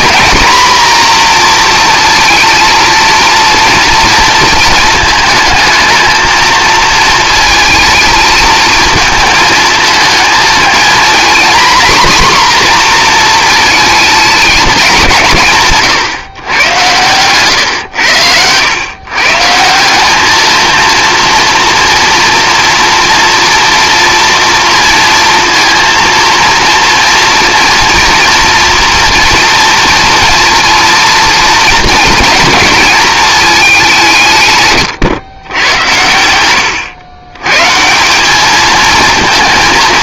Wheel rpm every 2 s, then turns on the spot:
230, 230, 220, 220, 220, 230, 240, 210, 110, 120, 230, 230, 230, 230, 230, 230, 220, 140, 110, 220.
none